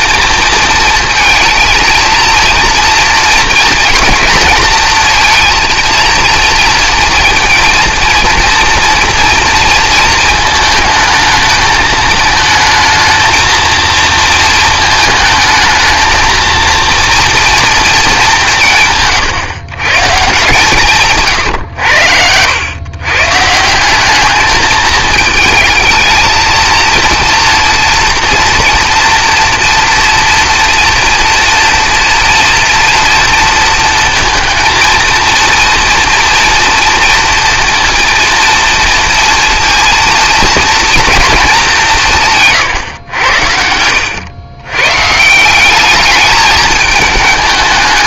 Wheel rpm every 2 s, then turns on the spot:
230, 230, 230, 230, 230, 220, 220, 220, 230, 160, 160, 100, 210, 230, 230, 230, 230, 230, 230, 230, 230, 120, 110, 210.
none